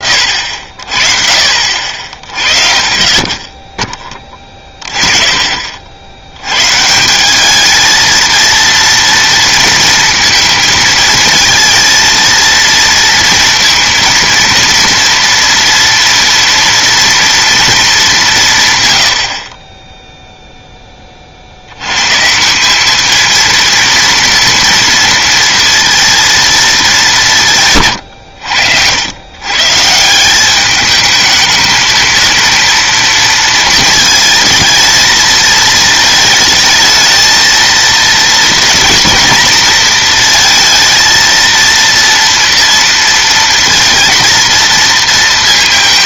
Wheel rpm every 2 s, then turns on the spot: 50, 30, 20, 130, 230, 230, 230, 230, 230, 140, 10, 200, 230, 220, 90, 210, 230, 220, 220, 230, 230, 230, 230.
none